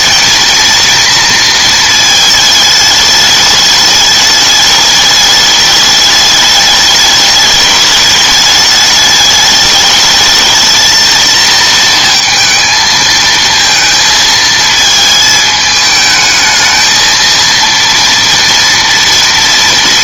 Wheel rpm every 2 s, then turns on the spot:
230, 210, 210, 210, 210, 220, 220, 220, 220, 230.
none